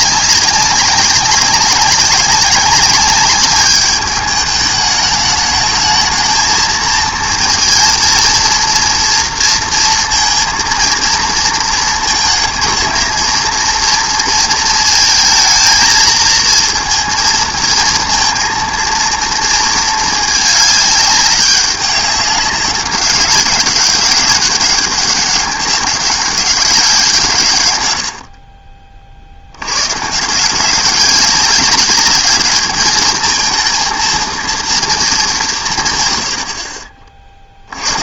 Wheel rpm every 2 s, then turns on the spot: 190, 200, 210, 230, 230, 230, 230, 230, 230, 230, 210, 200, 200, 190, 40, 180, 210, 230, 50.
none